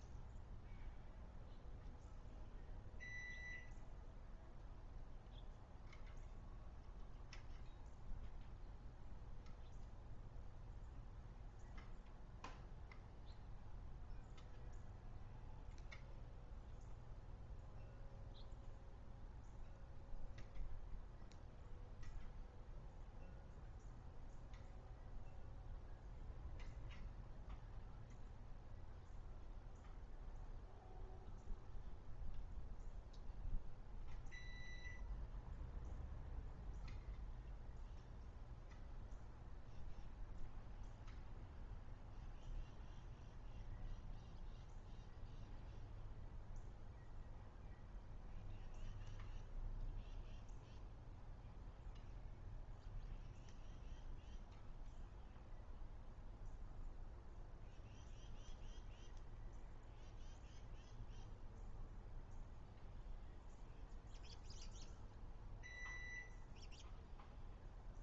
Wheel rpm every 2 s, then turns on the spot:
0, 0, 0, 0, 0, 0, 0, 0, 0, 0, 0, 0, 0, 0, 0, 0, 0, 0, 0, 0, 0, 0, 0, 0, 0, 0, 0, 0, 0, 0, 0, 0, 0, 0.
none